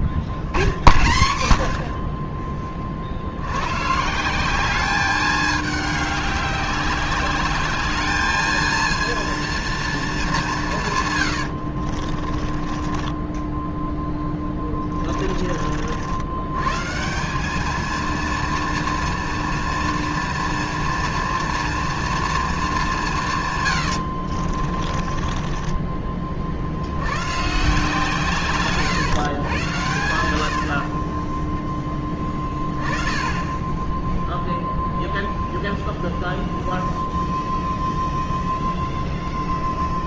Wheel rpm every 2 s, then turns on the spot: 50, 30, 200, 200, 230, 160, 30, 20, 140, 230, 230, 200, 30, 80, 130, 50, 10, 0, 0, 0.
12-16 24-26 30-32